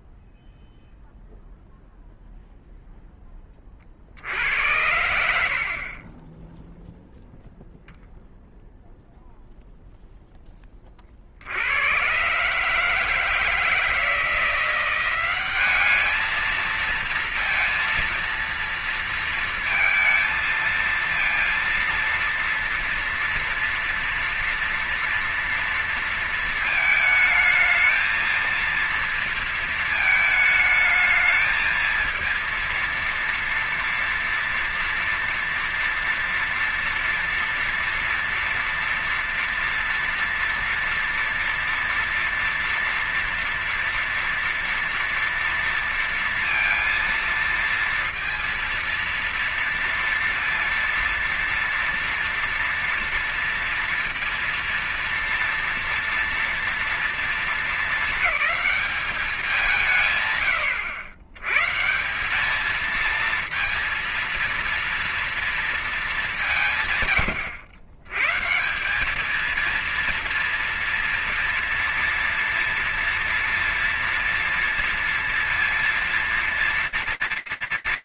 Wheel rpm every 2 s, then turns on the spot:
0, 0, 20, 70, 0, 0, 70, 160, 200, 230, 230, 230, 230, 230, 220, 220, 220, 230, 230, 230, 230, 230, 230, 230, 230, 230, 230, 230, 240, 220, 180, 120, 230, 220, 100, 210, 230, 230, 230.
none